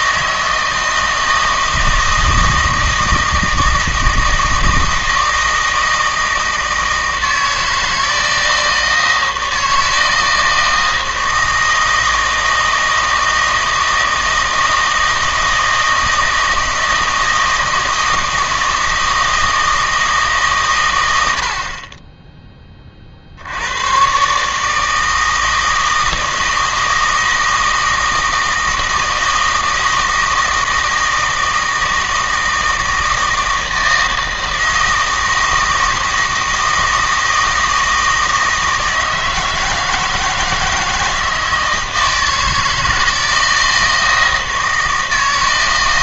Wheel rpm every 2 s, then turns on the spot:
160, 160, 160, 160, 160, 160, 160, 160, 160, 160, 140, 20, 150, 160, 160, 160, 160, 160, 160, 160, 160, 160, 160.
none